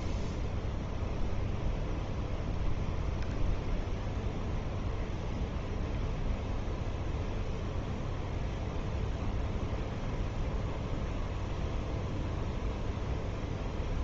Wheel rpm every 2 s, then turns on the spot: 0, 0, 0, 0, 0, 0, 0.
none